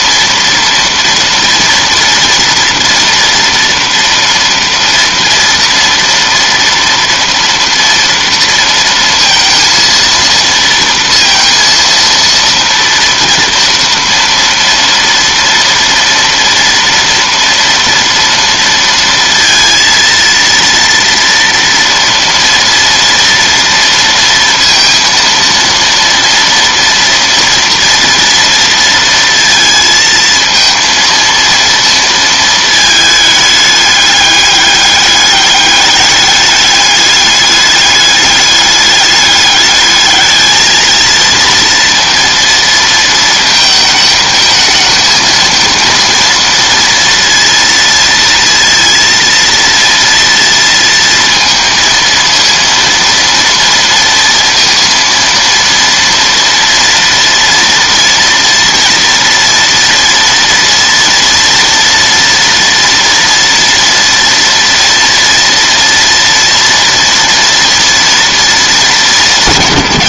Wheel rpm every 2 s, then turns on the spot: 230, 230, 230, 240, 230, 230, 230, 230, 230, 230, 230, 230, 230, 230, 230, 230, 220, 200, 200, 210, 220, 230, 220, 230, 230, 230, 230, 230, 230, 230, 230, 230, 230, 240, 210.
none